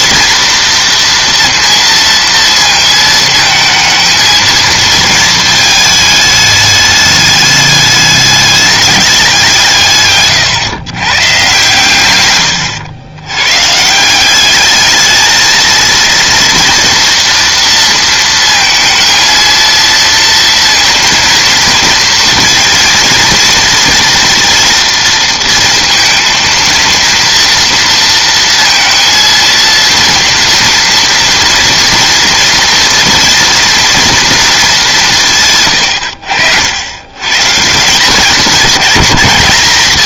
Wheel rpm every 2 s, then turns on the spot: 230, 230, 220, 210, 210, 120, 110, 210, 230, 230, 230, 230, 230, 230, 230, 230, 230, 200, 80, 210.
none